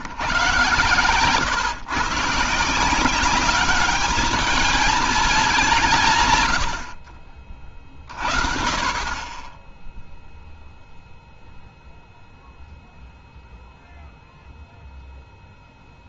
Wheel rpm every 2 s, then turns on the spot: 130, 160, 220, 90, 40, 0, 0, 0.
none